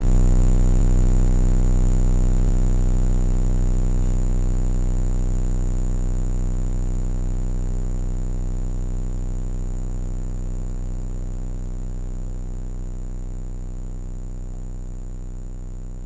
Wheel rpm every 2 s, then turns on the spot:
0, 0, 0, 0, 0, 0, 0, 0.
none